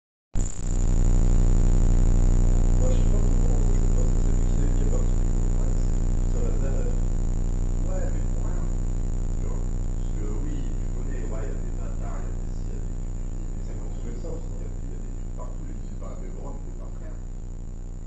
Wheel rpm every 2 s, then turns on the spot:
0, 0, 0, 0, 0, 0, 0, 0, 0.
none